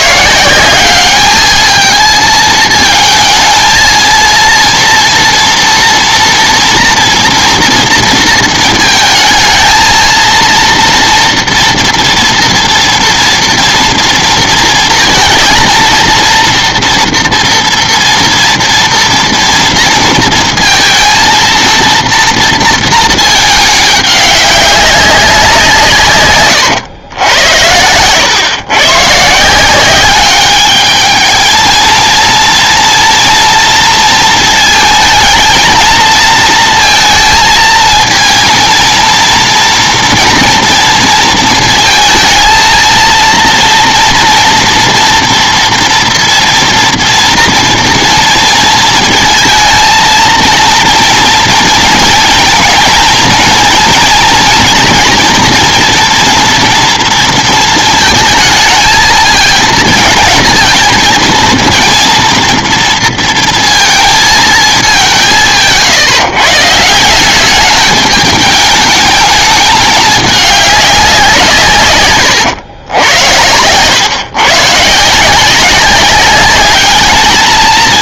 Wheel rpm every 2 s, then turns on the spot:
180, 220, 230, 230, 230, 230, 230, 230, 230, 230, 230, 230, 200, 120, 120, 210, 230, 230, 230, 230, 230, 230, 230, 230, 230, 230, 230, 230, 230, 220, 230, 230, 220, 150, 210, 210, 110, 130, 200.
none